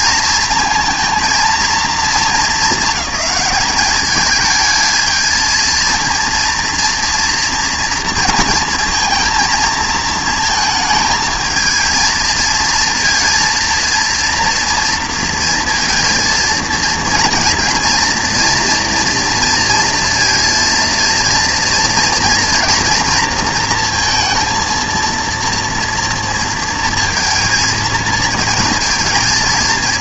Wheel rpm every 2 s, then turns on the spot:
230, 220, 220, 230, 230, 230, 230, 230, 230, 230, 230, 230, 230, 230, 230.
none